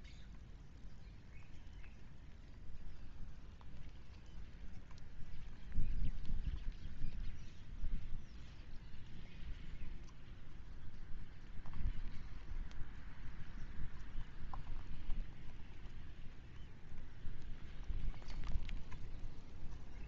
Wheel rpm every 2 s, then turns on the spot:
0, 0, 0, 0, 0, 0, 0, 0, 0, 0.
none